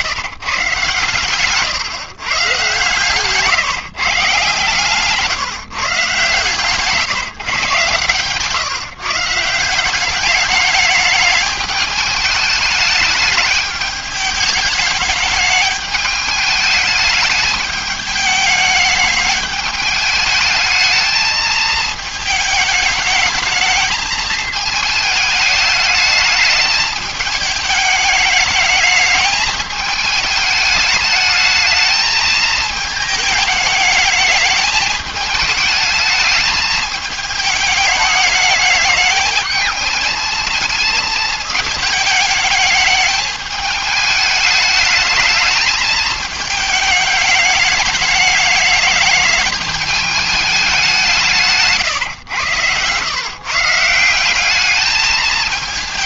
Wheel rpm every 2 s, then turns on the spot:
140, 130, 140, 140, 140, 210, 210, 210, 210, 210, 220, 220, 220, 210, 210, 210, 220, 210, 210, 210, 220, 220, 220, 220, 220, 200, 110, 200.
2-4 6-8